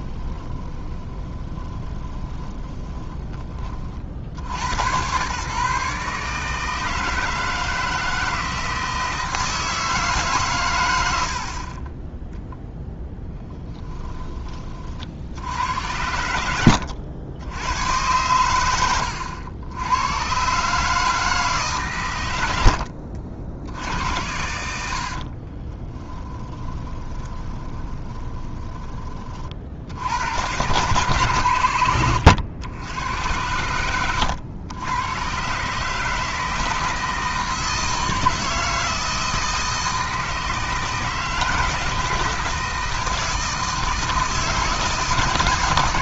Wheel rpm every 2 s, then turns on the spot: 20, 10, 110, 160, 160, 110, 0, 40, 80, 90, 150, 70, 80, 20, 20, 110, 90, 100, 160, 160, 160, 160, 160.
0-2 22-24 26-28